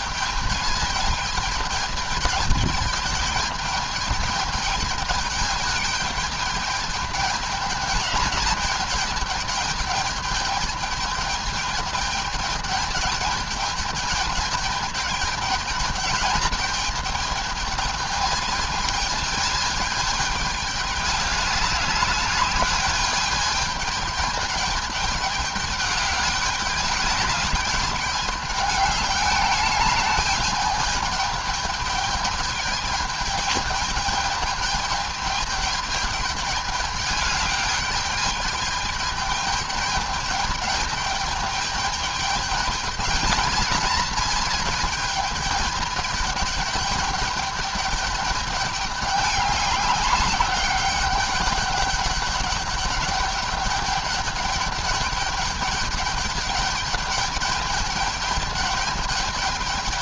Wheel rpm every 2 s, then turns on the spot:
210, 210, 210, 210, 210, 210, 210, 210, 220, 220, 210, 210, 210, 210, 210, 210, 210, 210, 210, 210, 210, 220, 220, 210, 210, 200, 200, 210, 210, 210.
none